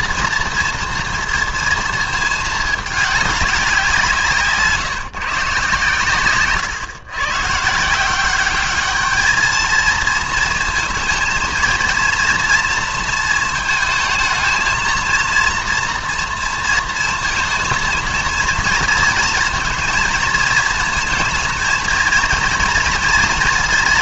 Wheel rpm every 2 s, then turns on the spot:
230, 220, 150, 120, 200, 230, 230, 230, 230, 230, 220, 230.
none